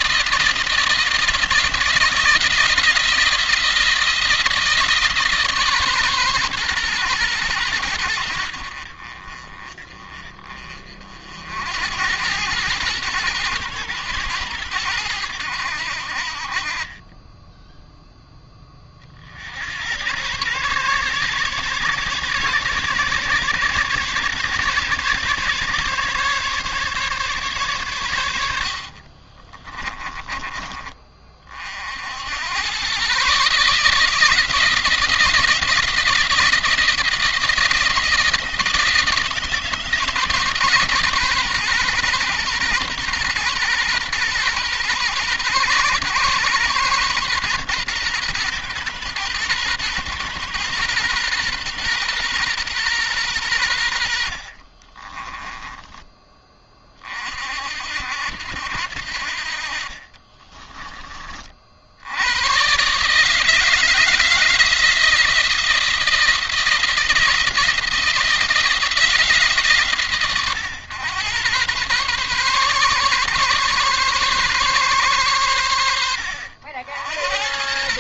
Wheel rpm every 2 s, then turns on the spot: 160, 170, 160, 120, 60, 40, 110, 100, 40, 30, 130, 140, 140, 150, 60, 30, 120, 170, 170, 160, 150, 120, 120, 120, 120, 120, 120, 40, 30, 70, 30, 130, 160, 170, 160, 110, 130, 130, 60.
28-30 54-56